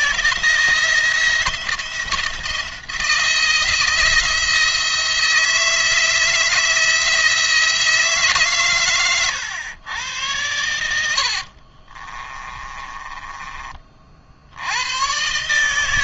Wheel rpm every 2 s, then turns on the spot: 160, 170, 170, 160, 130, 90, 20, 90.
10-14